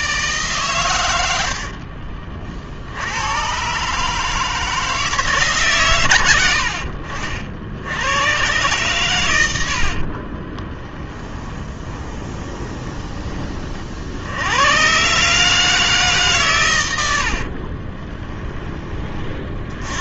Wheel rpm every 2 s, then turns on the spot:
110, 80, 160, 60, 120, 10, 20, 120, 100, 30.
10-14